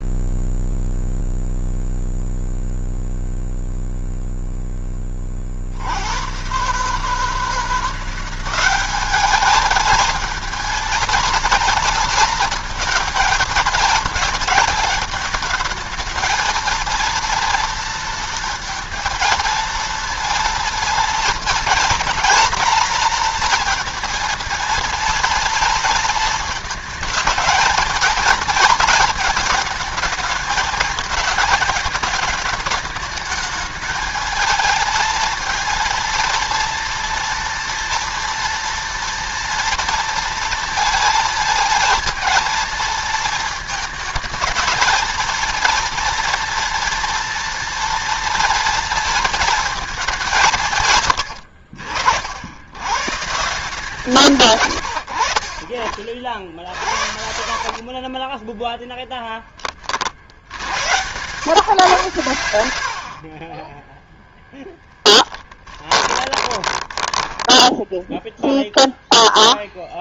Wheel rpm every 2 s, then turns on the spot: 0, 0, 10, 130, 190, 230, 230, 220, 230, 230, 230, 230, 230, 220, 220, 210, 210, 220, 230, 230, 230, 220, 220, 230, 230, 160, 110, 110, 60, 10, 90, 80, 0, 20, 0.
56-60 62-64 66-68